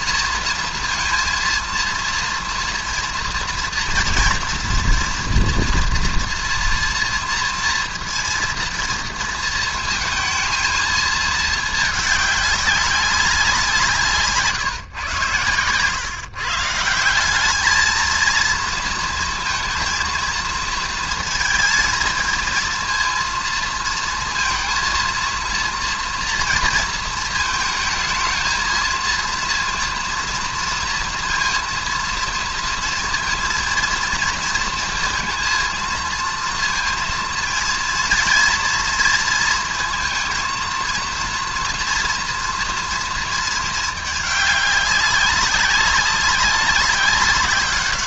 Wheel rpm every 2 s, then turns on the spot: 230, 230, 230, 230, 230, 220, 200, 150, 150, 230, 230, 230, 230, 230, 230, 230, 230, 230, 230, 230, 230, 240, 210, 200.
none